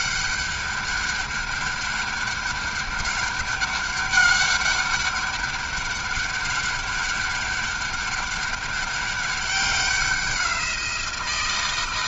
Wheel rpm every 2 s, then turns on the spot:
200, 200, 200, 200, 200, 180.
none